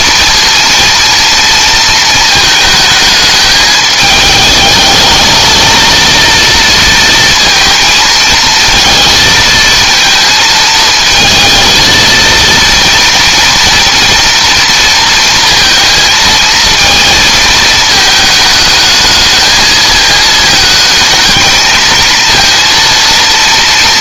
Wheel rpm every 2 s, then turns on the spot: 230, 220, 220, 230, 230, 220, 230, 230, 220, 220, 220, 230.
none